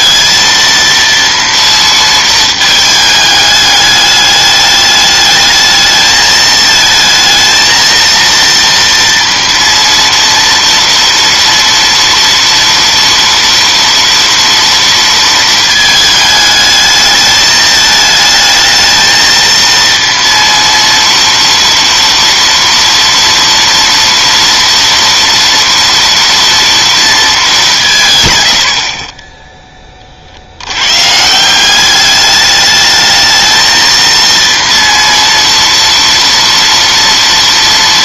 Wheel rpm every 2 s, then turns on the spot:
230, 220, 210, 220, 230, 230, 230, 230, 210, 220, 230, 230, 230, 230, 60, 100, 210, 230, 230.
none